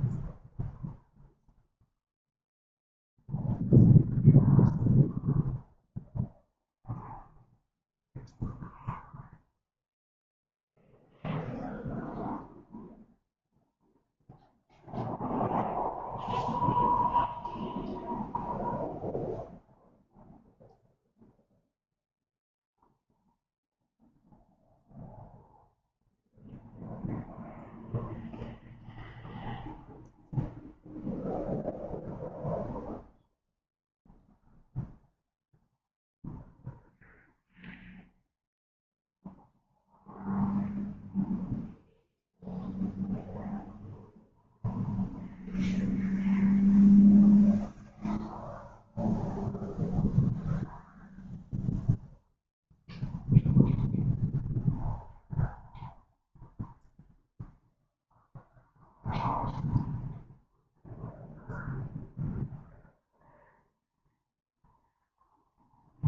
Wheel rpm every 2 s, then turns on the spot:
0, 0, 0, 0, 0, 0, 0, 0, 0, 0, 0, 0, 0, 0, 0, 0, 0, 0, 0, 0, 0, 0, 0, 0, 0, 0, 0, 0, 0, 0, 0, 0, 0.
none